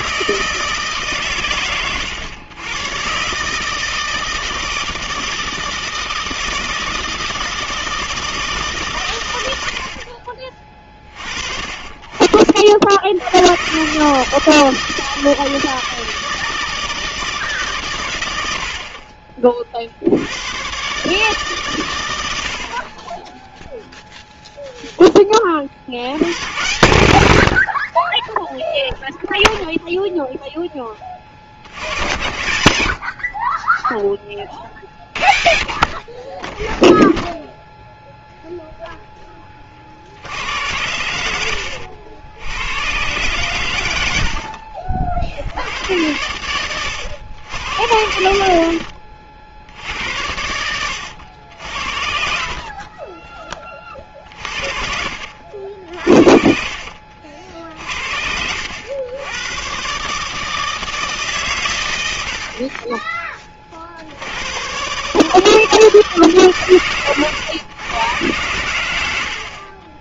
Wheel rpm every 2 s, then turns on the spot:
160, 110, 160, 160, 150, 30, 50, 160, 160, 70, 110, 60, 0, 100, 0, 10, 80, 40, 10, 0, 80, 90, 50, 90, 60, 100, 50, 40, 50, 80, 160, 50, 110, 130, 100.
44-46 48-50 52-54 56-58